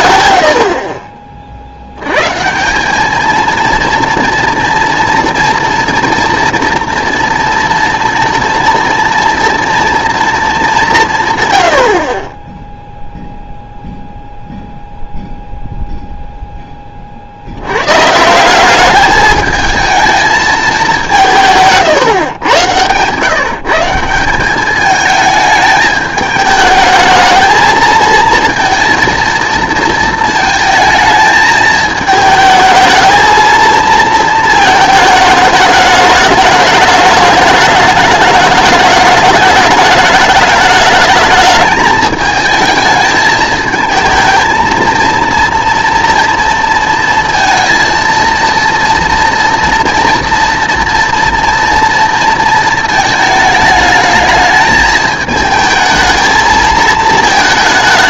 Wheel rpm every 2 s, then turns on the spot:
60, 170, 230, 230, 230, 200, 10, 0, 10, 190, 210, 120, 200, 220, 230, 220, 220, 220, 210, 210, 210, 220, 230, 230, 230, 240, 230, 220, 220.
none